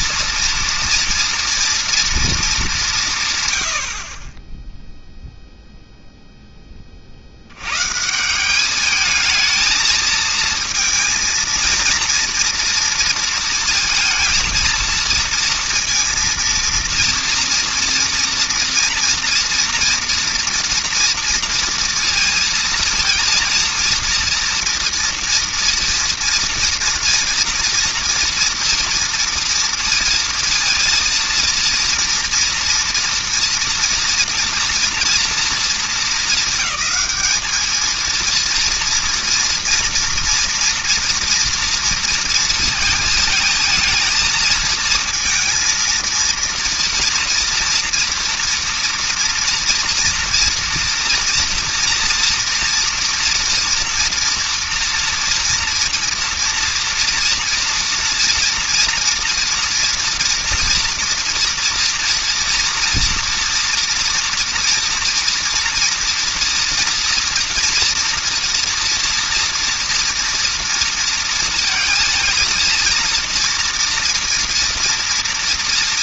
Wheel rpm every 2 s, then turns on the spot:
220, 230, 150, 0, 50, 220, 230, 230, 230, 230, 240, 230, 230, 230, 230, 230, 230, 230, 230, 210, 230, 230, 220, 230, 240, 240, 230, 230, 230, 230, 230, 230, 240, 230, 230, 230, 230, 230.
none